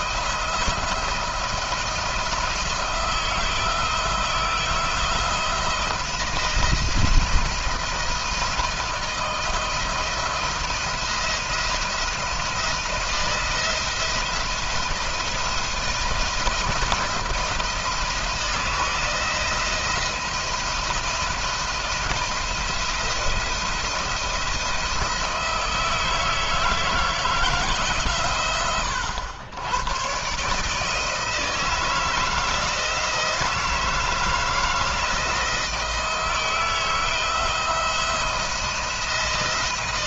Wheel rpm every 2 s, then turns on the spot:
170, 160, 170, 170, 170, 170, 170, 160, 170, 160, 170, 170, 170, 160, 110, 160, 170, 170, 160, 170.
none